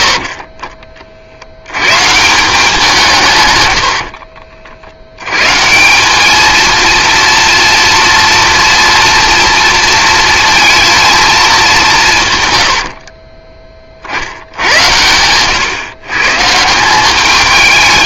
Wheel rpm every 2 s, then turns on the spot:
40, 170, 70, 230, 240, 230, 80, 90, 180.
12-14